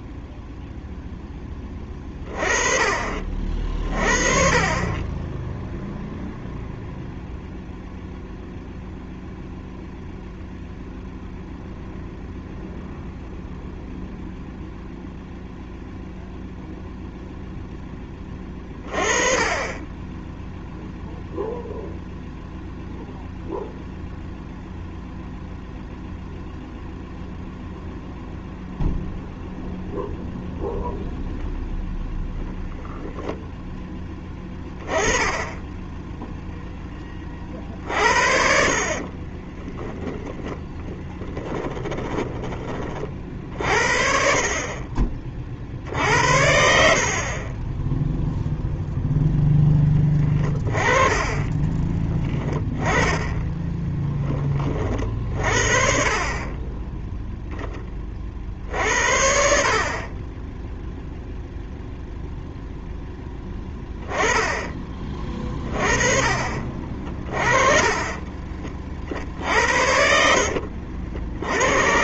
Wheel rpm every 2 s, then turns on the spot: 0, 40, 30, 0, 0, 0, 0, 0, 0, 20, 0, 0, 0, 0, 0, 0, 0, 20, 10, 40, 10, 30, 30, 60, 0, 20, 10, 40, 10, 60, 0, 0, 20, 40, 40, 60.
38-42 50-52